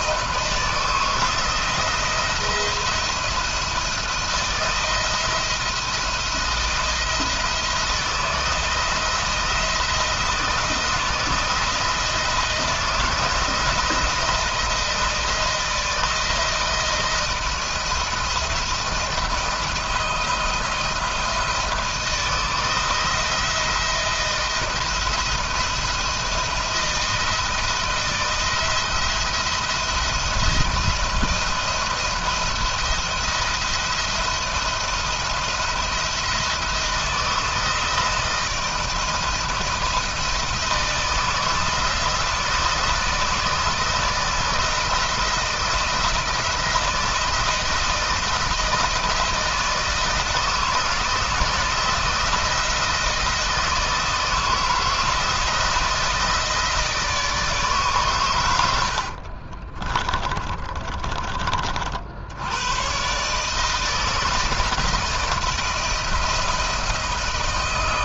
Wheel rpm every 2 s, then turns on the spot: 160, 170, 170, 170, 160, 170, 160, 170, 160, 170, 170, 170, 170, 170, 170, 170, 170, 170, 170, 170, 160, 170, 170, 170, 160, 160, 160, 160, 160, 80, 30, 120, 160, 160.
58-60